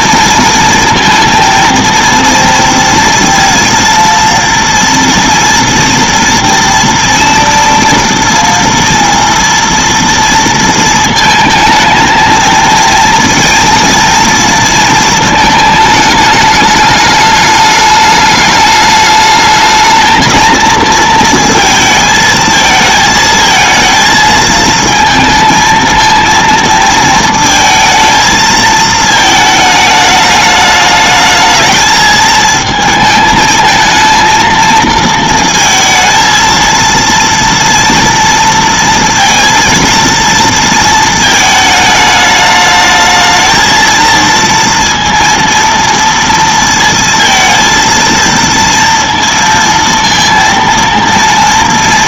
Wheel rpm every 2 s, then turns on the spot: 230, 230, 230, 230, 230, 230, 230, 230, 210, 210, 230, 220, 220, 220, 220, 210, 220, 230, 230, 230, 230, 220, 230, 230, 230, 230.
none